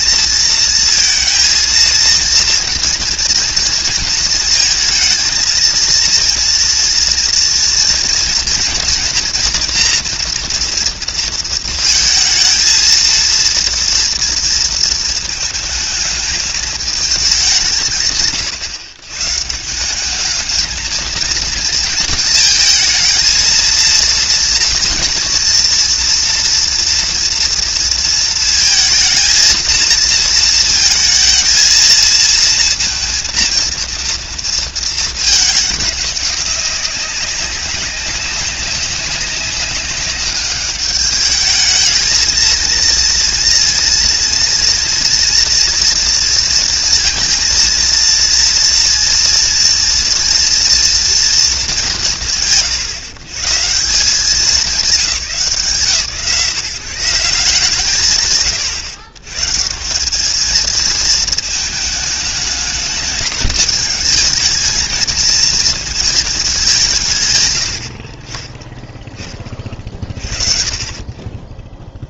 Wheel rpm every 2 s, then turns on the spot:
230, 230, 230, 240, 230, 230, 230, 230, 210, 140, 220, 230, 230, 230, 220, 230, 230, 230, 200, 190, 200, 230, 230, 230, 230, 240, 100, 180, 160, 110, 220, 210, 220, 200, 20, 50.
none